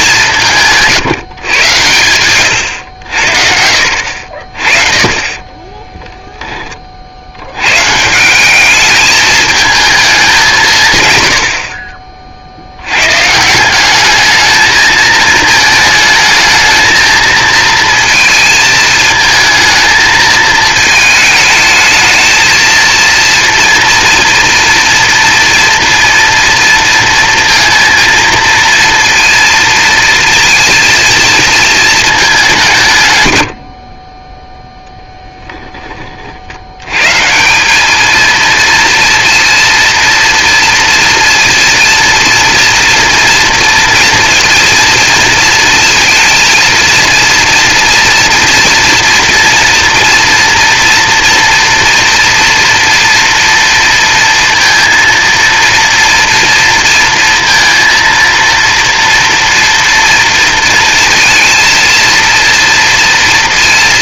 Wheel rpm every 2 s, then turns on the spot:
170, 100, 40, 20, 200, 180, 60, 220, 220, 220, 220, 230, 240, 230, 230, 230, 190, 0, 60, 230, 230, 230, 240, 230, 230, 230, 230, 230, 230, 230, 230, 230.
none